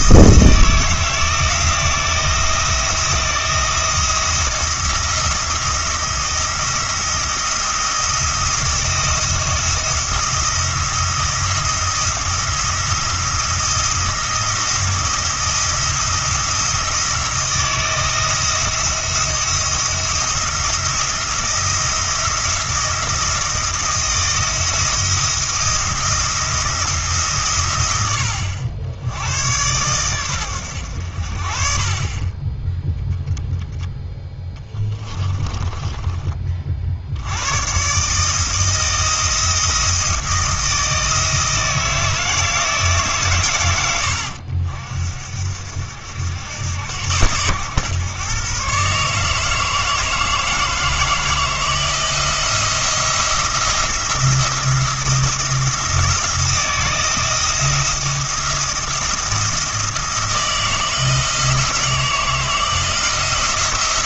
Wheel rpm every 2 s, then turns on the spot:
160, 170, 170, 170, 170, 160, 160, 170, 170, 170, 170, 170, 170, 160, 70, 100, 10, 10, 40, 160, 160, 150, 60, 90, 140, 160, 170, 170, 170, 170, 160, 160.
34-36